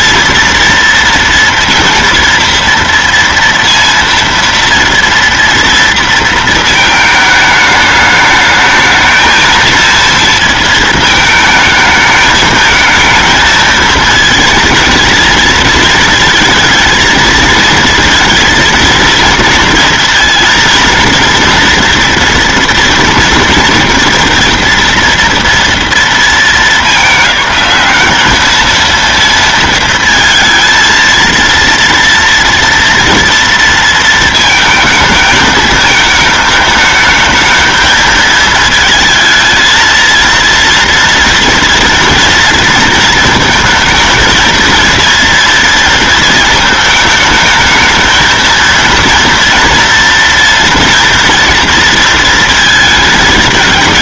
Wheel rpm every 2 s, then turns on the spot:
230, 230, 230, 220, 220, 220, 220, 220, 220, 230, 230, 230, 230, 200, 220, 220, 230, 220, 210, 220, 230, 230, 230, 220, 230, 230, 220.
none